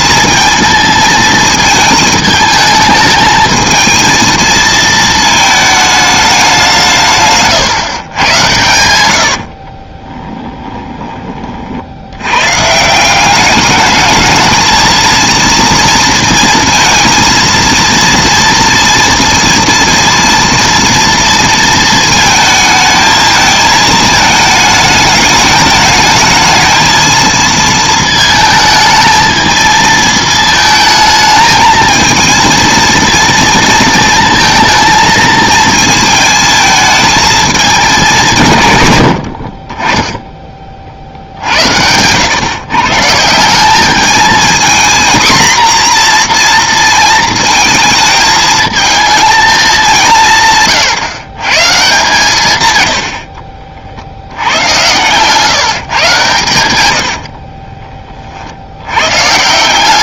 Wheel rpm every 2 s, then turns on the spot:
220, 220, 220, 180, 90, 10, 130, 220, 230, 230, 230, 220, 220, 220, 220, 220, 230, 230, 220, 130, 40, 120, 230, 230, 220, 150, 120, 100, 100, 80.
8-12 54-56